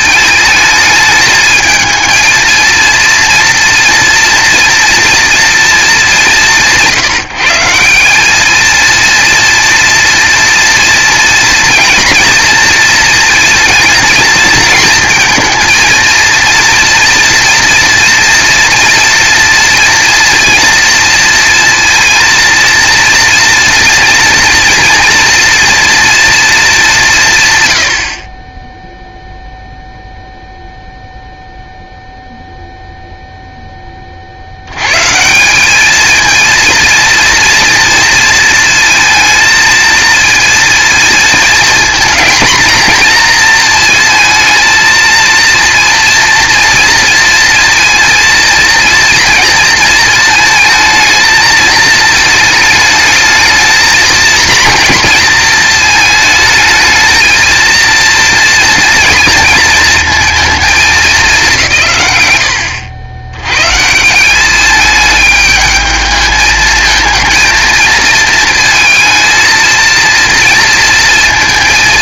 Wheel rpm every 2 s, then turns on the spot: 220, 230, 230, 170, 220, 230, 220, 230, 230, 230, 230, 230, 230, 200, 0, 0, 0, 110, 230, 230, 230, 230, 230, 230, 230, 220, 220, 230, 220, 230, 210, 80, 210, 220, 220, 230.
none